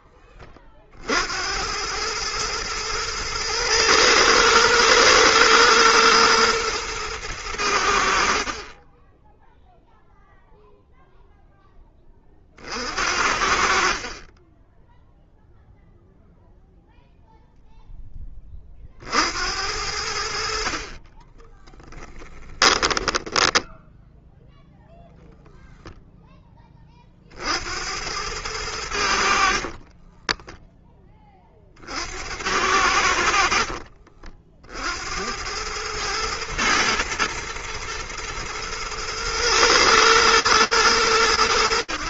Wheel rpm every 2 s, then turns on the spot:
40, 110, 110, 110, 20, 0, 50, 10, 0, 40, 40, 10, 0, 20, 90, 10, 80, 50, 110, 110, 110.
22-24